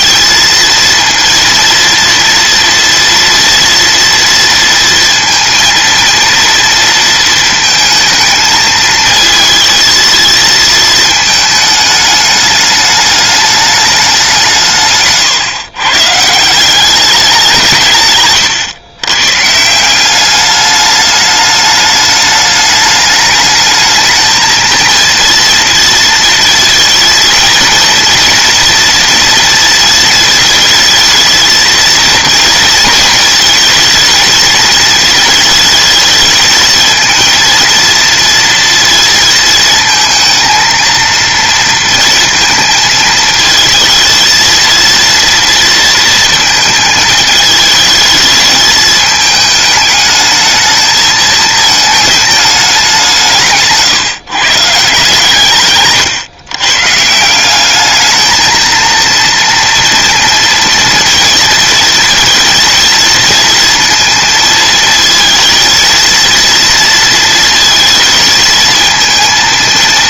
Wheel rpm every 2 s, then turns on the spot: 230, 230, 230, 230, 220, 220, 210, 140, 190, 110, 210, 210, 230, 230, 230, 220, 230, 220, 220, 230, 230, 220, 230, 220, 220, 220, 190, 140, 140, 230, 230, 230, 220, 230, 220.
14-16